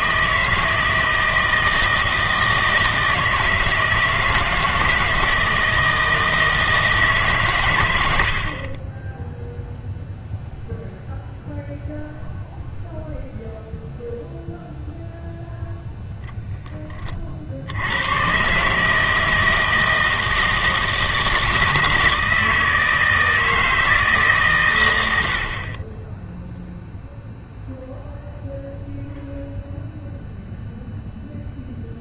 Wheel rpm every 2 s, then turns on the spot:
160, 160, 160, 160, 30, 0, 0, 0, 20, 150, 160, 160, 120, 0, 0, 0.
none